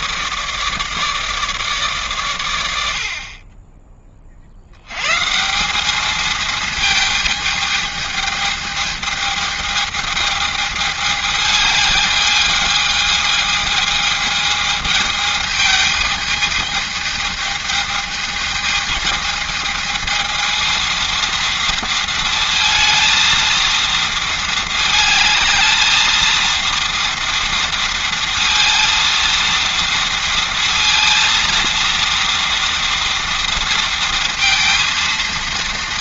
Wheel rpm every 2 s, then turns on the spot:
150, 80, 100, 220, 220, 210, 220, 220, 210, 220, 220, 230, 220, 230, 230, 230, 230, 230.
none